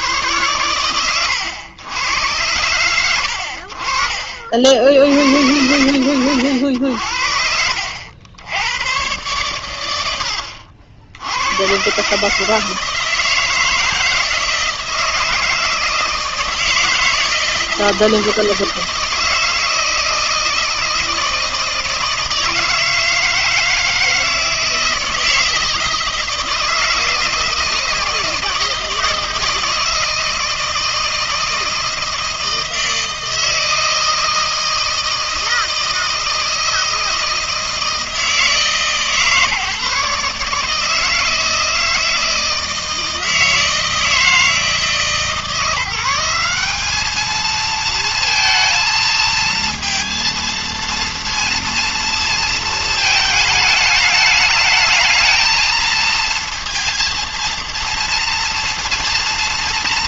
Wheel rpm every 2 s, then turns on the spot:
100, 100, 60, 80, 100, 60, 150, 160, 160, 160, 160, 160, 160, 160, 160, 160, 160, 160, 160, 160, 150, 160, 150, 190, 230, 230, 230, 210, 230, 230.
none